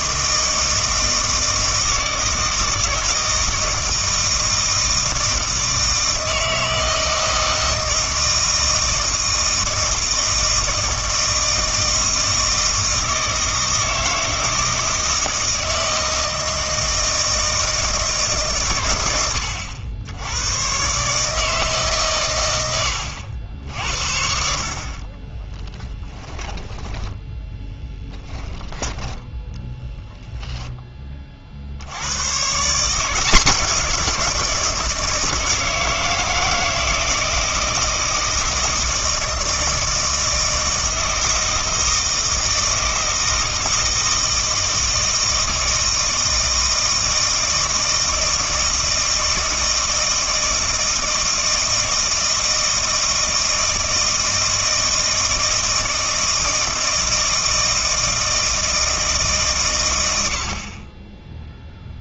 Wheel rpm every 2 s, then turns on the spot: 160, 160, 160, 160, 160, 160, 160, 160, 160, 120, 110, 100, 60, 20, 10, 10, 150, 170, 160, 160, 160, 160, 160, 160, 160, 160, 160, 160, 160, 160, 50.
22-24 26-30